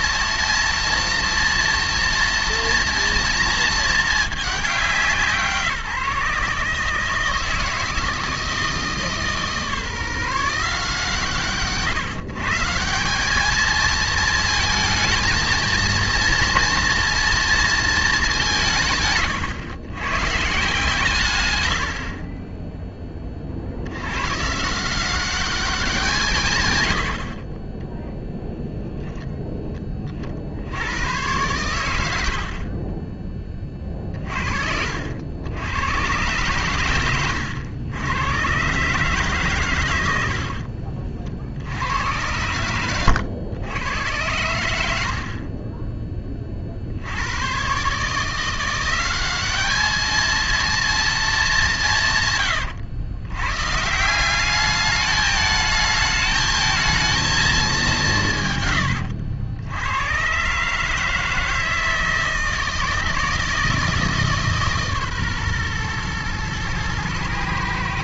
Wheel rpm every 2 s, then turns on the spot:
230, 230, 200, 150, 160, 150, 160, 220, 230, 160, 140, 20, 160, 120, 0, 80, 50, 60, 110, 130, 60, 110, 90, 50, 170, 230, 120, 200, 220, 130, 140, 160, 150, 120.
32-34